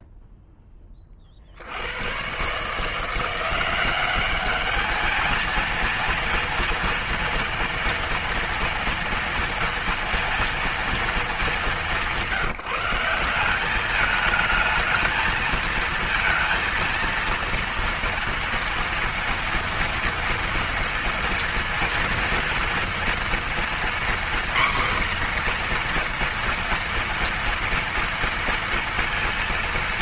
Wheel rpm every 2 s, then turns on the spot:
0, 130, 200, 230, 230, 230, 180, 210, 230, 240, 230, 230, 250, 240, 230.
none